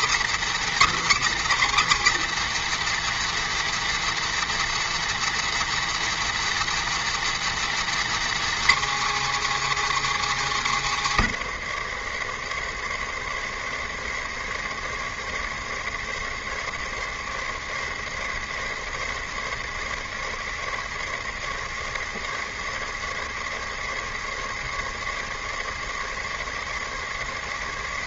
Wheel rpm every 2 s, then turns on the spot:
300, 300, 300, 300, 290, 250, 140, 140, 140, 150, 140, 140, 140, 140.
none